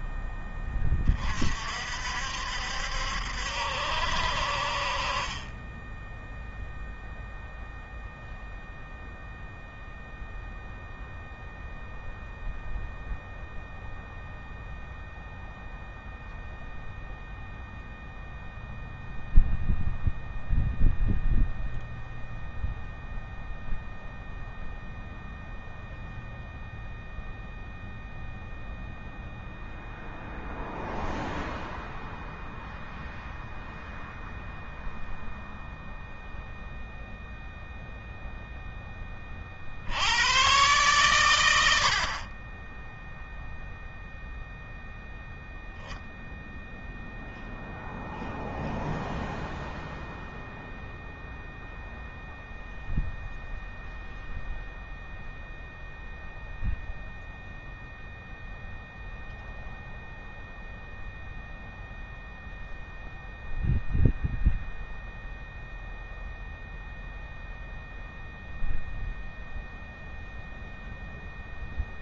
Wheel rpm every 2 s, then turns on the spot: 10, 60, 50, 0, 0, 0, 0, 0, 0, 0, 0, 0, 0, 0, 0, 0, 0, 0, 0, 10, 120, 20, 0, 0, 0, 0, 0, 0, 0, 0, 0, 0, 0, 0, 0, 0.
none